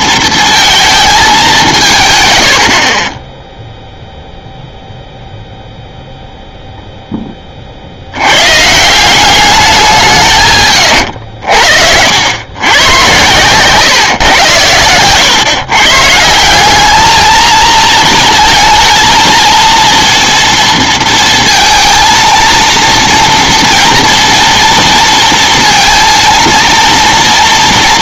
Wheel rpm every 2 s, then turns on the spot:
230, 80, 0, 0, 130, 90, 100, 110, 180, 230, 230, 230, 230, 230.
none